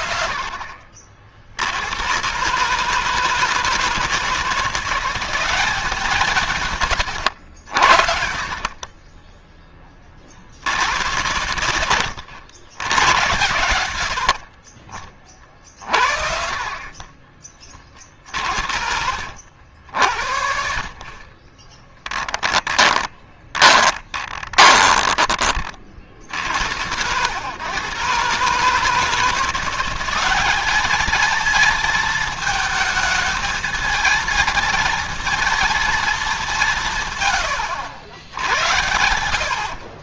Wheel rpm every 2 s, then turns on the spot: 50, 150, 180, 140, 40, 90, 110, 40, 30, 60, 50, 30, 20, 80, 150, 210, 220, 230, 170, 70.
6-10 18-20 22-26